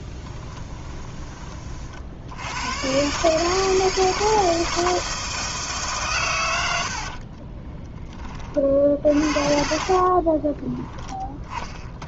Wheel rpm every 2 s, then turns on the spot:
10, 110, 160, 90, 40, 10.
0-2 10-12